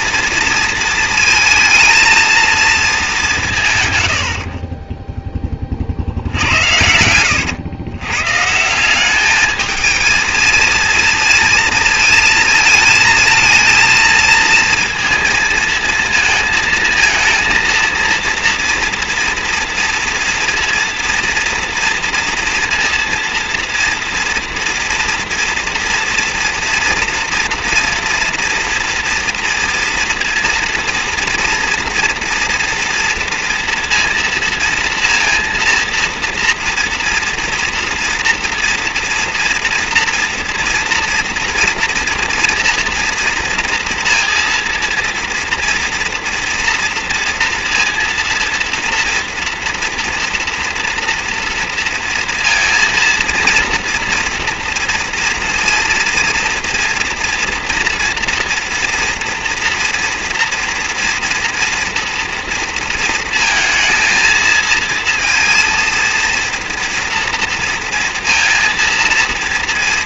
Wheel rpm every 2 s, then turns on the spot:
230, 230, 50, 90, 160, 230, 220, 230, 220, 230, 230, 230, 230, 230, 230, 230, 230, 230, 230, 230, 240, 230, 230, 230, 230, 240, 230, 230, 240, 240, 230, 230, 230, 230, 230.
4-6